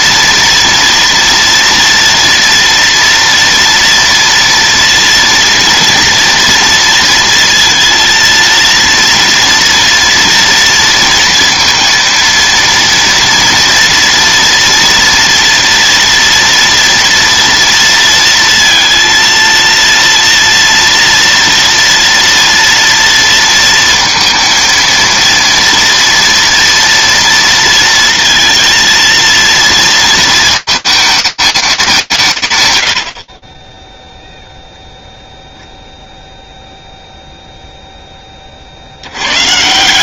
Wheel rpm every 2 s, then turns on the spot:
230, 240, 230, 230, 230, 230, 230, 240, 230, 230, 230, 230, 230, 230, 230, 220, 80, 0, 0, 70.
none